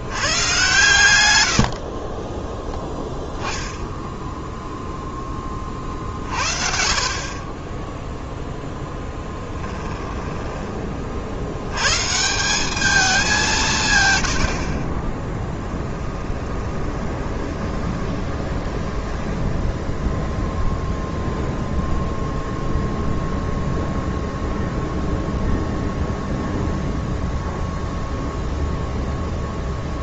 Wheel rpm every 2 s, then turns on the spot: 120, 10, 0, 50, 20, 30, 200, 20, 20, 10, 0, 0, 0, 0, 0.
8-10 16-20